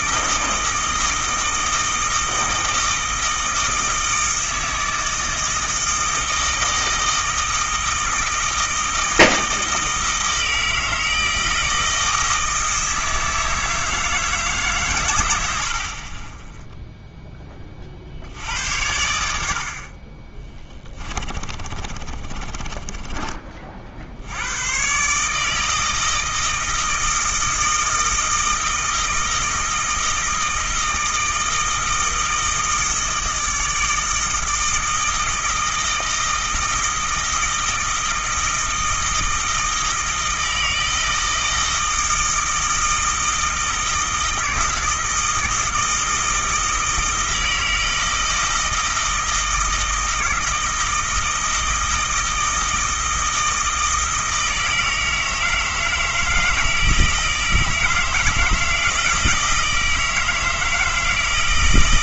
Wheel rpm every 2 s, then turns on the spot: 160, 160, 160, 160, 160, 160, 160, 130, 0, 90, 20, 20, 110, 160, 160, 160, 160, 160, 160, 160, 160, 160, 160, 160, 160, 160, 160, 160, 160, 160, 160.
20-24